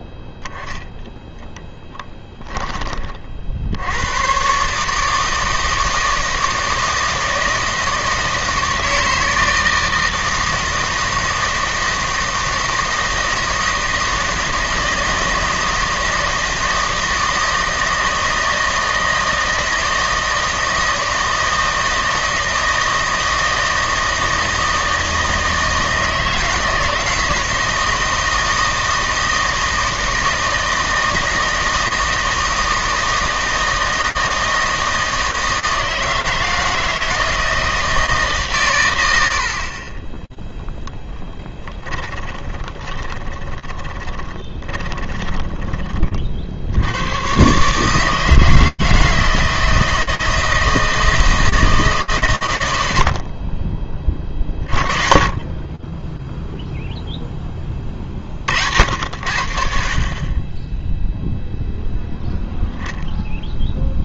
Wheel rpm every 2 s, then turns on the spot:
0, 20, 140, 160, 160, 160, 160, 160, 160, 160, 160, 160, 160, 160, 160, 160, 160, 160, 160, 130, 0, 20, 20, 70, 160, 160, 100, 40, 0, 50, 10, 0.
42-46